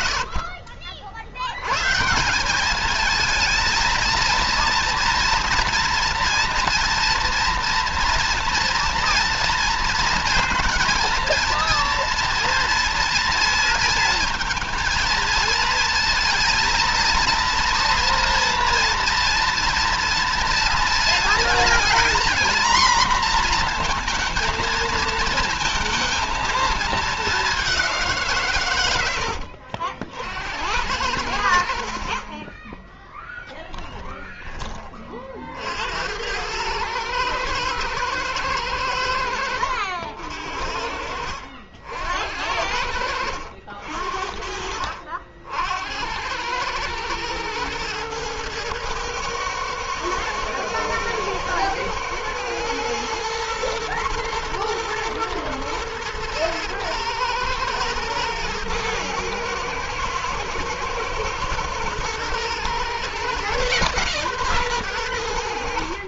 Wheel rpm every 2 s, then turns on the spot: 50, 200, 230, 230, 230, 230, 230, 230, 230, 240, 230, 240, 230, 220, 110, 80, 10, 30, 110, 100, 70, 80, 60, 100, 120, 110, 110, 110, 110, 110, 110, 120, 120.
32-34